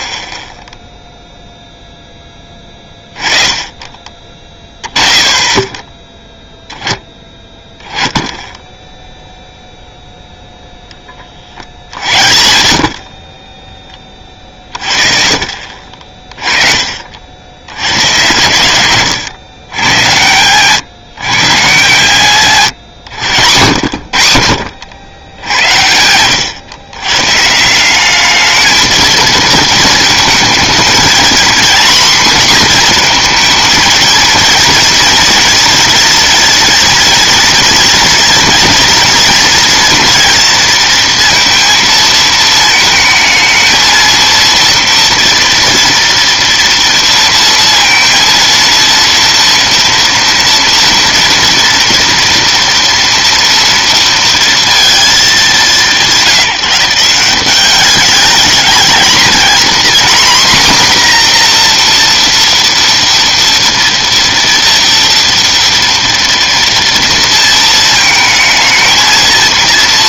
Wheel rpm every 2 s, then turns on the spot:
0, 20, 20, 10, 10, 10, 60, 40, 40, 110, 130, 130, 90, 120, 220, 230, 240, 230, 230, 230, 230, 220, 230, 230, 230, 230, 240, 230, 170, 220, 250, 230, 230, 230, 220.
14-16